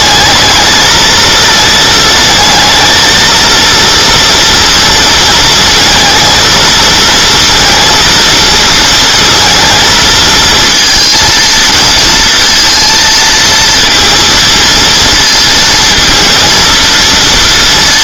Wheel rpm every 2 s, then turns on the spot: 220, 230, 230, 230, 230, 230, 230, 230, 230.
none